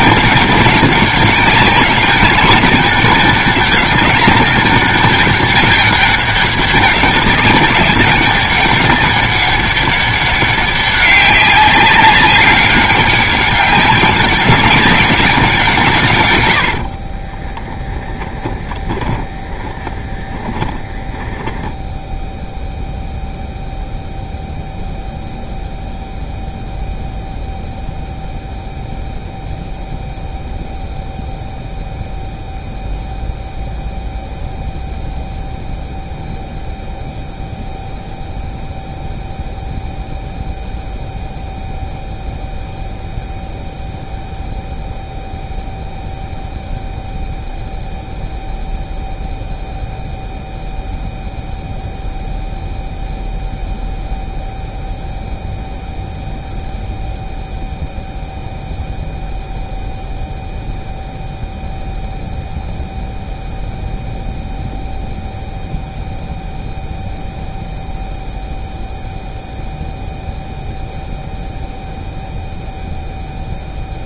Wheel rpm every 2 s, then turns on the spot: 200, 200, 200, 190, 200, 200, 190, 190, 60, 20, 10, 0, 0, 0, 0, 0, 0, 0, 0, 0, 0, 0, 0, 0, 0, 0, 0, 0, 0, 0, 0, 0, 0, 0, 0, 0, 0.
16-22